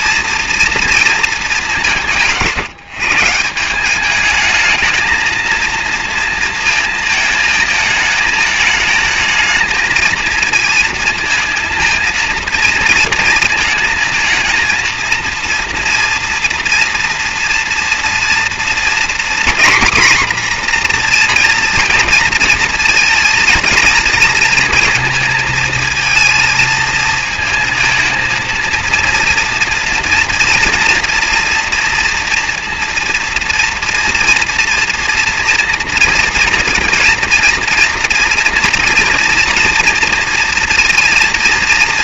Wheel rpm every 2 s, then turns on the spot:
230, 160, 220, 220, 220, 220, 230, 220, 230, 230, 240, 230, 220, 220, 220, 230, 230, 230, 220, 230, 240.
none